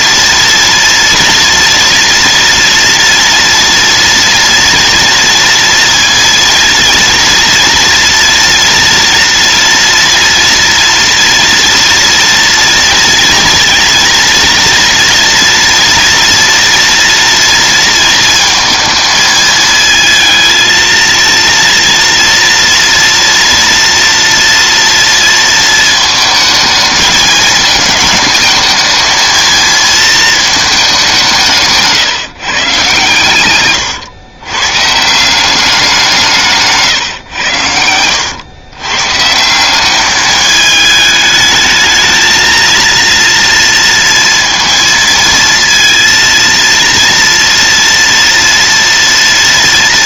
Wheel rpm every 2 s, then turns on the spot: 230, 230, 230, 230, 230, 230, 230, 230, 230, 220, 230, 230, 230, 220, 220, 210, 130, 140, 140, 130, 210, 230, 230, 230, 230.
none